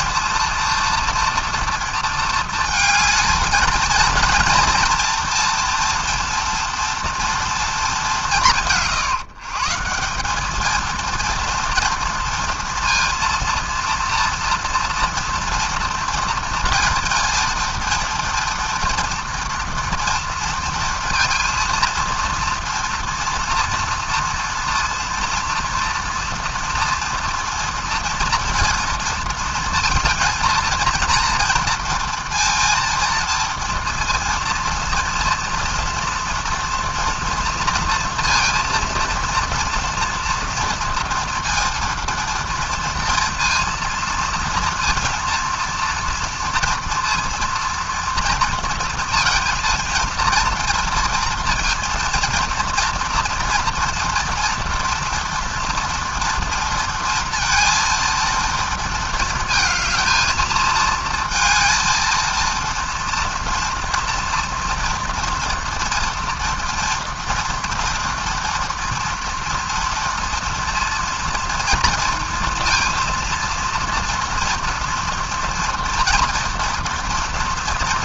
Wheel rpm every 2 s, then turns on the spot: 230, 220, 230, 230, 170, 230, 230, 230, 230, 230, 230, 230, 230, 230, 230, 230, 230, 230, 230, 230, 230, 230, 230, 240, 230, 230, 230, 240, 230, 230, 220, 230, 230, 230, 230, 230, 230, 230, 230.
none